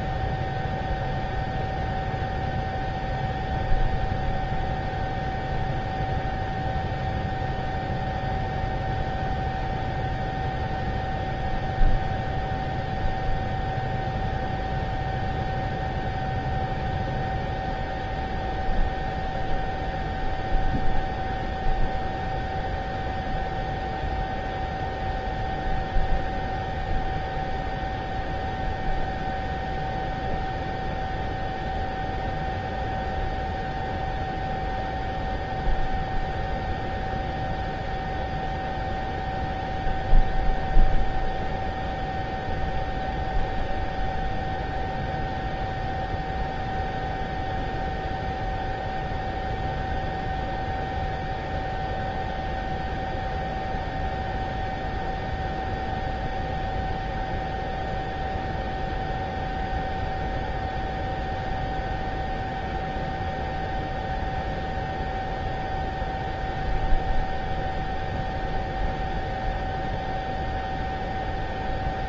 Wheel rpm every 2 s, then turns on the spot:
0, 0, 0, 0, 0, 0, 0, 0, 0, 0, 0, 0, 0, 0, 0, 0, 0, 0, 0, 0, 0, 0, 0, 0, 0, 0, 0, 0, 0, 0, 0, 0, 0, 0, 0, 0.
none